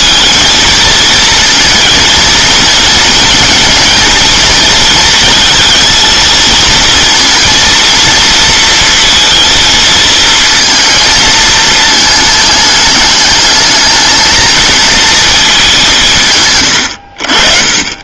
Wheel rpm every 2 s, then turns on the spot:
230, 220, 220, 230, 230, 230, 210, 230, 120.
none